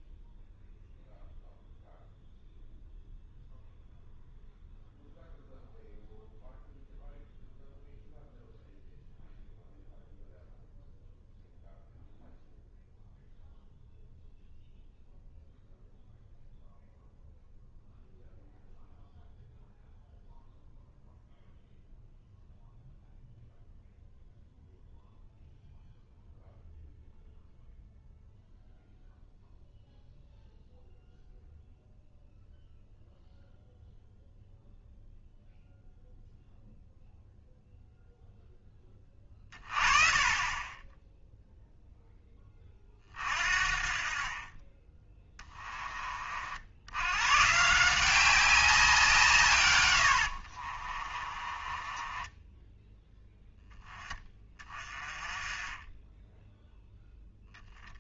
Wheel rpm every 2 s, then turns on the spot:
0, 0, 0, 0, 0, 0, 0, 0, 0, 0, 0, 0, 0, 0, 0, 0, 0, 0, 0, 10, 10, 30, 20, 70, 190, 50, 10, 20, 0.
50-54